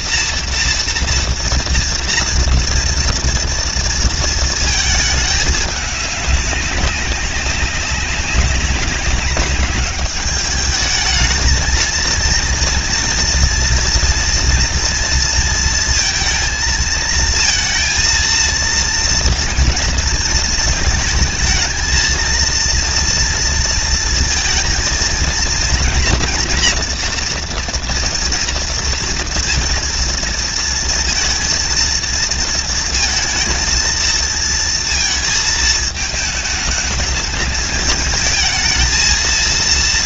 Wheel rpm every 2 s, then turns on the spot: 230, 230, 220, 200, 190, 210, 230, 230, 230, 230, 230, 230, 230, 240, 230, 230, 230, 230, 220, 220.
none